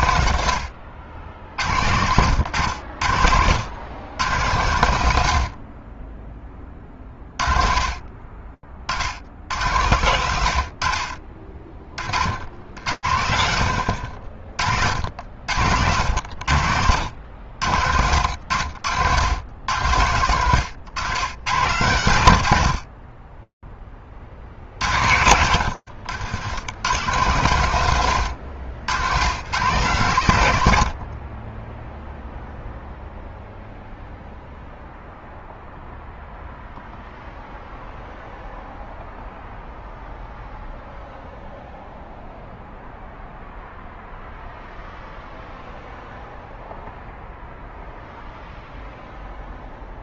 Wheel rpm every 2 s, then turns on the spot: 60, 90, 90, 40, 30, 80, 20, 50, 70, 90, 100, 140, 30, 80, 130, 140, 10, 0, 0, 0, 0, 0, 0, 0, 0.
none